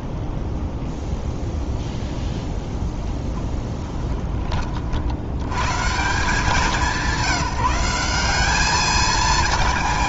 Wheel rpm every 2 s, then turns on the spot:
0, 0, 50, 190, 210.
none